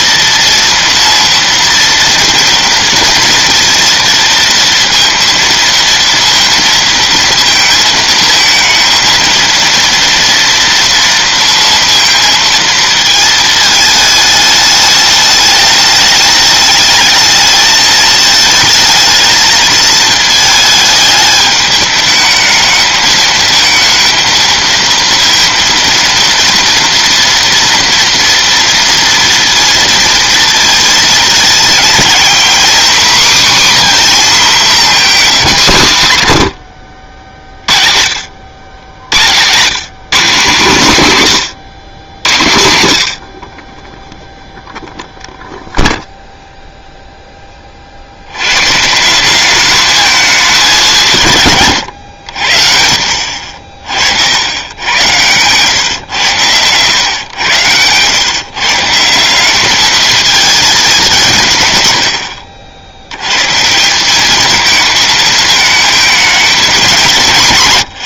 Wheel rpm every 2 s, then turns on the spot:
230, 230, 230, 230, 230, 230, 230, 210, 210, 220, 220, 220, 230, 230, 230, 230, 260, 230, 70, 90, 180, 80, 0, 0, 130, 200, 70, 100, 110, 150, 210, 70, 220, 200.
none